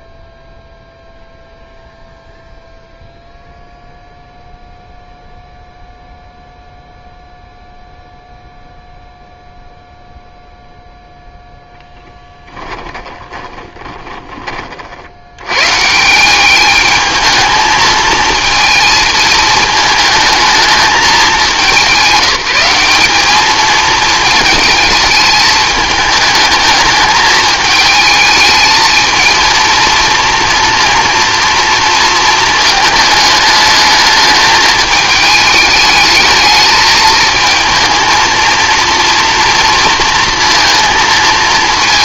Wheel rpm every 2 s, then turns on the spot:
0, 0, 0, 0, 0, 0, 10, 50, 210, 220, 210, 200, 220, 210, 220, 230, 220, 220, 220, 230, 230.
12-14